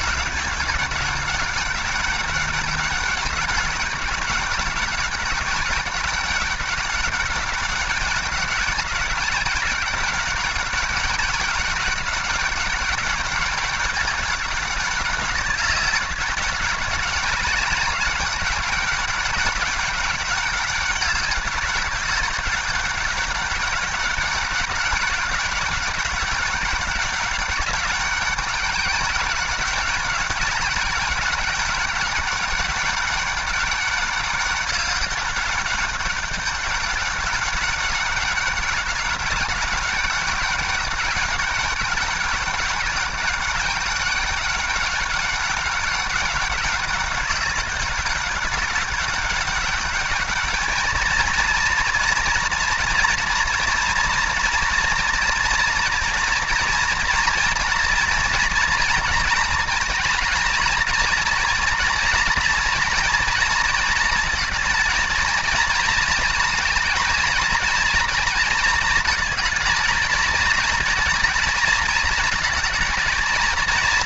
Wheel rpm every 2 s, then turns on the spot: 200, 200, 200, 200, 190, 200, 200, 200, 200, 200, 200, 200, 200, 200, 200, 200, 200, 200, 200, 190, 200, 200, 200, 200, 200, 220, 240, 230, 230, 230, 230, 230, 220, 220, 220, 230, 220.
none